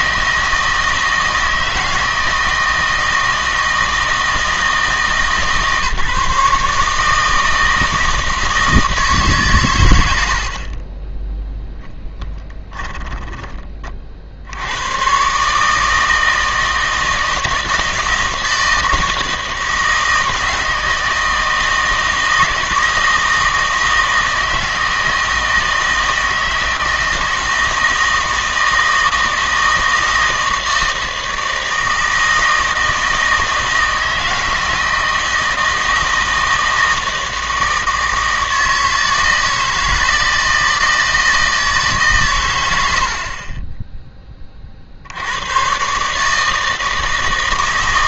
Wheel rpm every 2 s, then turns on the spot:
160, 160, 160, 150, 160, 40, 20, 90, 160, 160, 160, 160, 160, 160, 160, 160, 160, 160, 160, 160, 160, 100, 40, 160.
12-14